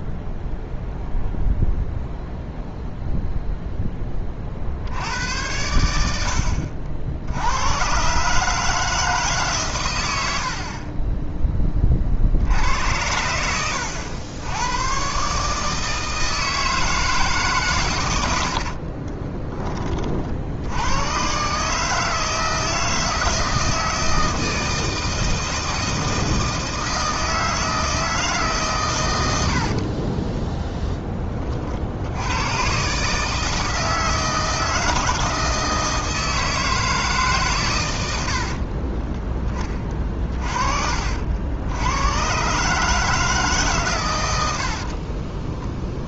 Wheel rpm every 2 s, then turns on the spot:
0, 0, 50, 60, 150, 70, 80, 100, 160, 80, 70, 160, 160, 160, 140, 20, 110, 160, 160, 70, 40, 130, 80.
18-20 30-32 38-40